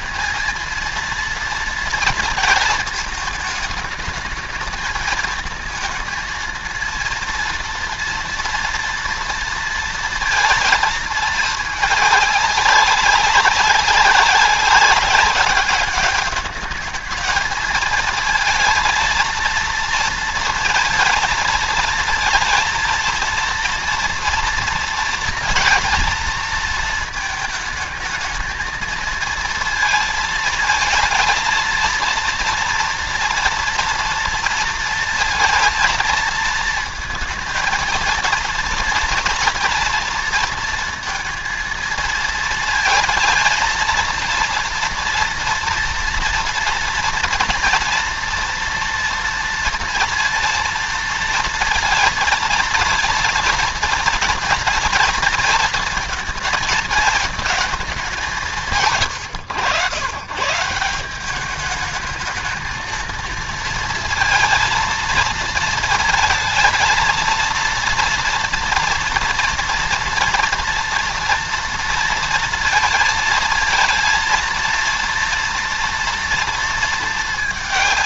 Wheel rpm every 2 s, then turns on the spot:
230, 220, 220, 230, 230, 220, 200, 190, 210, 230, 230, 230, 230, 230, 230, 220, 230, 230, 230, 230, 230, 230, 230, 230, 230, 230, 230, 230, 220, 140, 170, 230, 230, 230, 230, 230, 230, 230, 220.
none